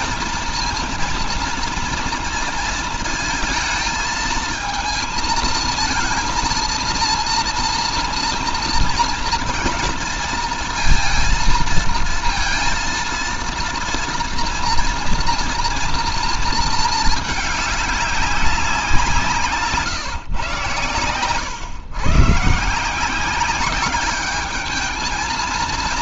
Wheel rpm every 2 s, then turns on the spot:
230, 230, 220, 230, 230, 230, 230, 230, 220, 190, 120, 150, 210.
none